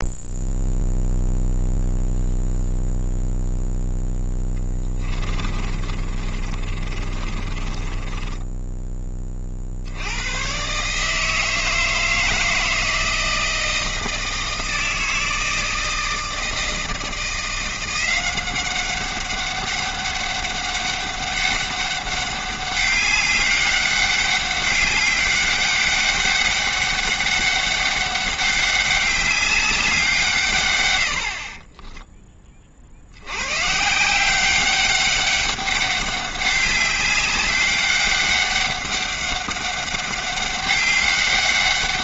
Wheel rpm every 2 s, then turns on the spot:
0, 0, 20, 30, 10, 130, 160, 160, 160, 190, 200, 200, 200, 200, 200, 110, 40, 190, 190, 200, 200.
4-8